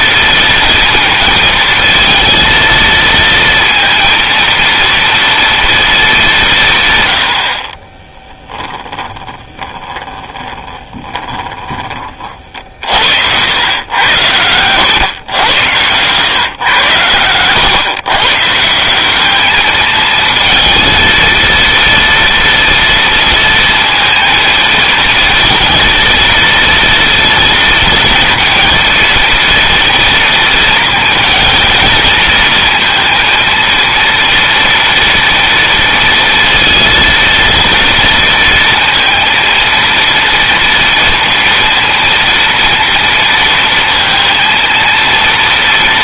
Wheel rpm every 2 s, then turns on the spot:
230, 230, 230, 140, 10, 10, 50, 100, 110, 170, 230, 230, 220, 230, 230, 230, 230, 240, 230, 230, 230, 230, 230.
8-12